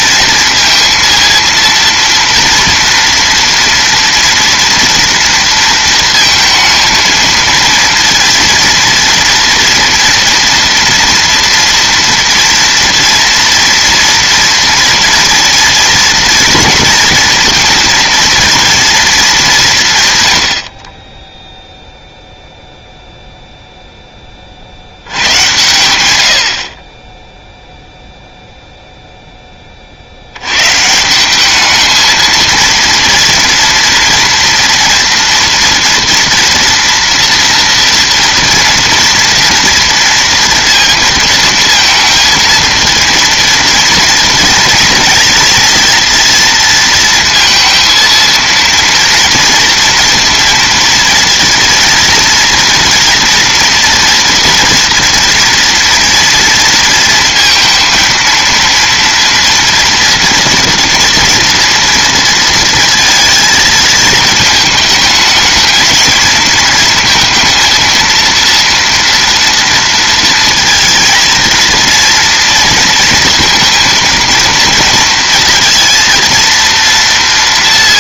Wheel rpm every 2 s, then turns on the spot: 230, 230, 230, 220, 230, 230, 230, 240, 230, 230, 40, 0, 60, 50, 0, 130, 230, 230, 240, 230, 230, 230, 230, 230, 230, 230, 230, 240, 230, 240, 240, 230, 220, 220, 230, 230, 230, 230, 230.
none